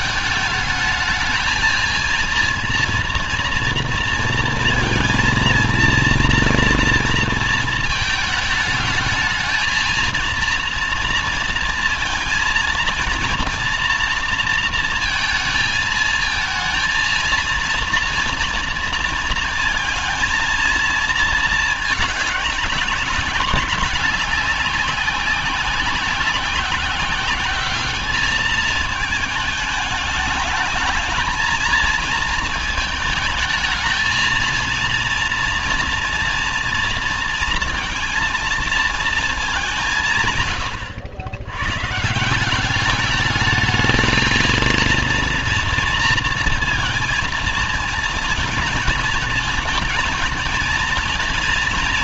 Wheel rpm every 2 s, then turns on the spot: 220, 230, 230, 230, 220, 230, 230, 230, 220, 230, 230, 210, 190, 190, 220, 210, 220, 230, 230, 230, 130, 180, 230, 230, 220, 230.
none